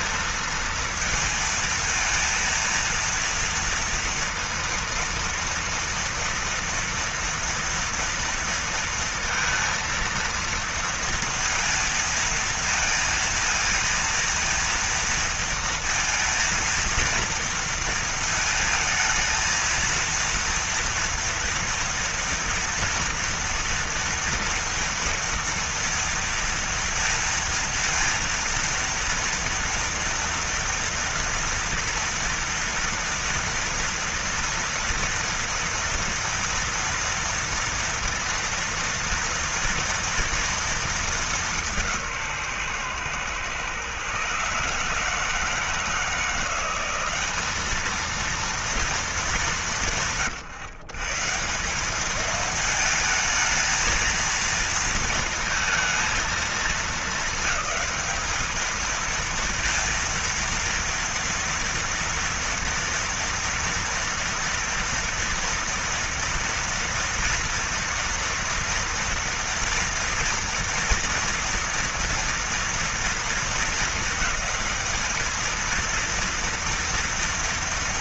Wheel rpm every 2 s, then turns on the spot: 230, 230, 230, 230, 230, 230, 230, 230, 230, 230, 230, 230, 230, 230, 230, 230, 230, 230, 230, 230, 230, 170, 130, 160, 220, 160, 210, 230, 230, 220, 230, 230, 230, 230, 230, 230, 230, 200, 230.
none